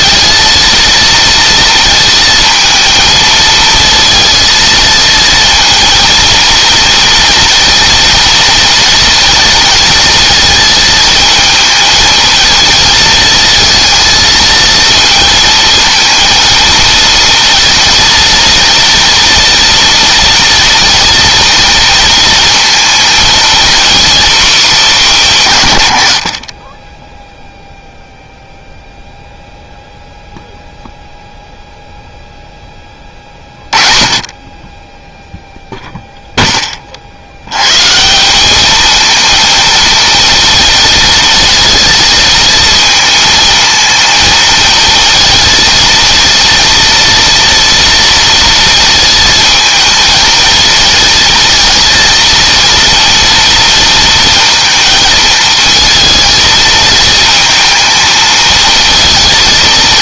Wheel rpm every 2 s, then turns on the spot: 230, 230, 230, 230, 230, 220, 230, 230, 230, 240, 240, 230, 220, 10, 0, 0, 20, 20, 30, 220, 230, 220, 230, 230, 230, 230, 230, 230, 220, 220.
none